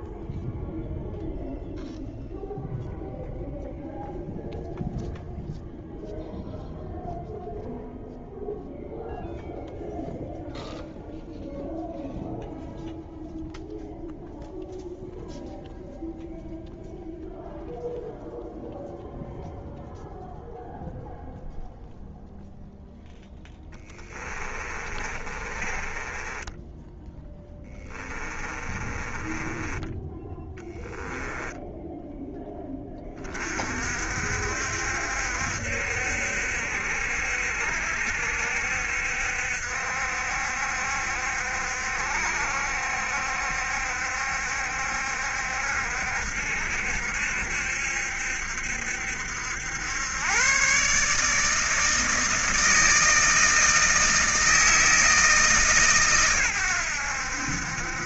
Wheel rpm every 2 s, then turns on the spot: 0, 0, 0, 0, 0, 0, 0, 0, 0, 0, 0, 0, 30, 10, 20, 10, 20, 60, 60, 70, 60, 70, 70, 60, 70, 130, 160, 160, 100.
24-32